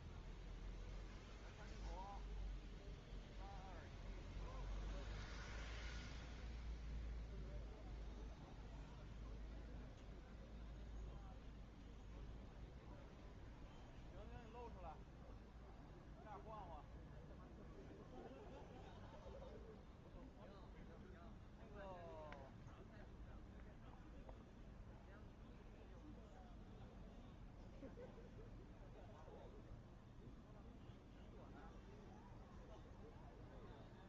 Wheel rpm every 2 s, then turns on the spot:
0, 0, 0, 0, 0, 0, 0, 0, 0, 0, 0, 0, 0, 0, 0, 0, 0.
none